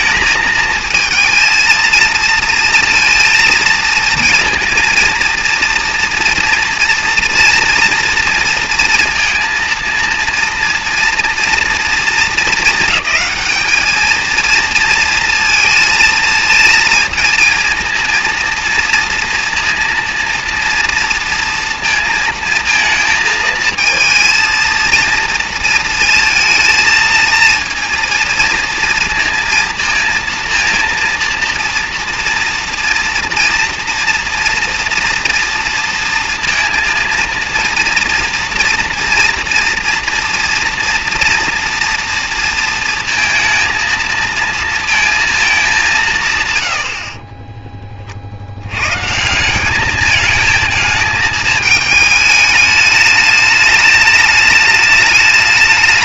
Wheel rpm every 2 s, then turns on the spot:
220, 230, 230, 230, 240, 230, 220, 230, 230, 230, 230, 230, 230, 230, 230, 230, 230, 230, 230, 240, 230, 230, 230, 90, 100, 220, 210, 210.
none